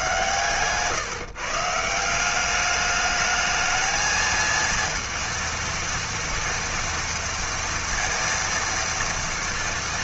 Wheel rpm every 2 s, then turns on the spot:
140, 200, 230, 230, 230.
none